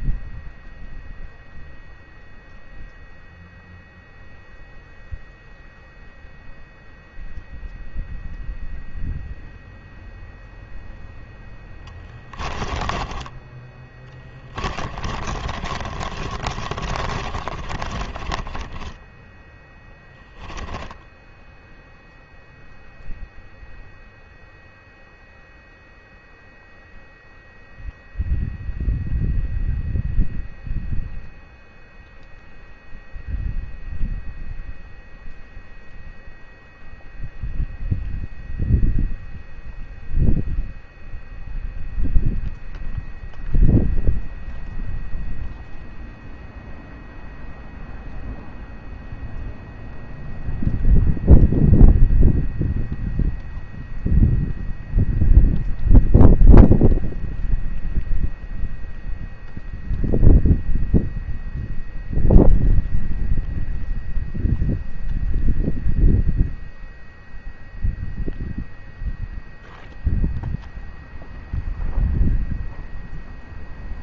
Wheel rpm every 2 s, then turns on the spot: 0, 0, 0, 0, 0, 0, 20, 20, 40, 20, 10, 0, 0, 0, 0, 0, 0, 0, 0, 0, 0, 0, 0, 0, 0, 0, 0, 0, 0, 0, 0, 0, 0, 0, 0, 0, 0.
12-22